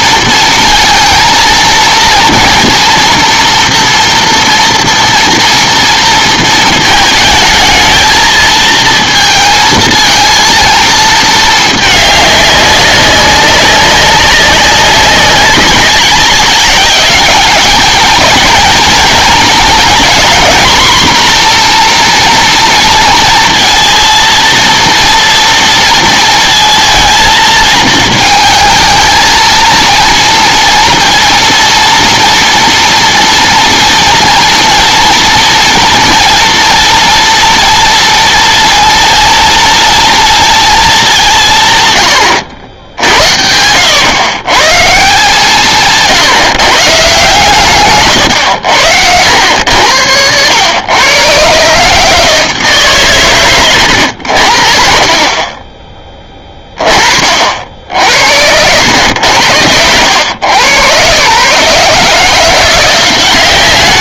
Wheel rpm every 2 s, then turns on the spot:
230, 230, 230, 230, 220, 230, 200, 200, 200, 220, 240, 230, 230, 230, 220, 240, 230, 230, 230, 230, 230, 90, 140, 150, 110, 100, 160, 60, 20, 90, 110, 170.
48-50